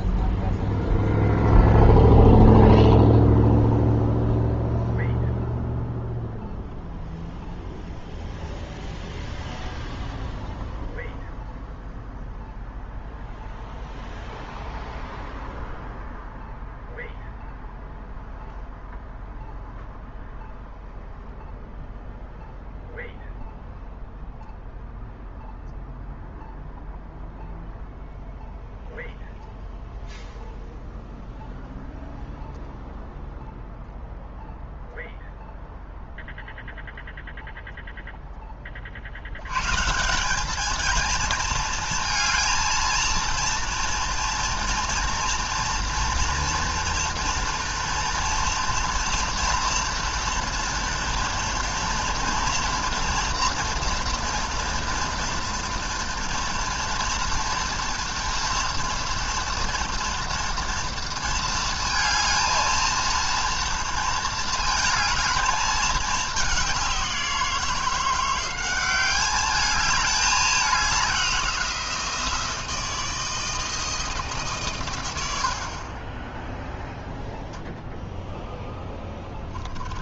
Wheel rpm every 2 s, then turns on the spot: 0, 0, 0, 0, 0, 0, 0, 0, 0, 0, 0, 0, 0, 0, 0, 0, 0, 0, 0, 30, 220, 230, 230, 230, 230, 230, 240, 230, 230, 230, 230, 230, 230, 200, 190, 200, 160, 140, 0, 0.
none